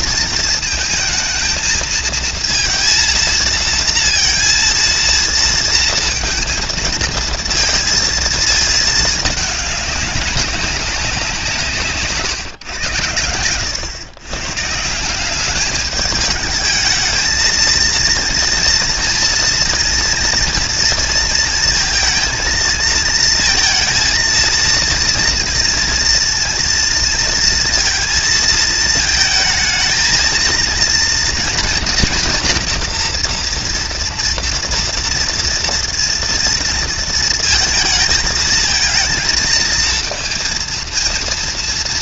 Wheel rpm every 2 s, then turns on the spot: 220, 230, 230, 230, 220, 190, 120, 140, 210, 230, 230, 230, 230, 230, 220, 230, 240, 230, 230, 220, 230.
none